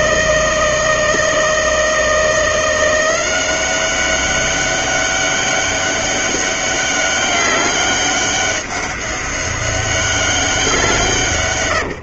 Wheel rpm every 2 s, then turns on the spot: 160, 170, 200, 200, 200, 170.
none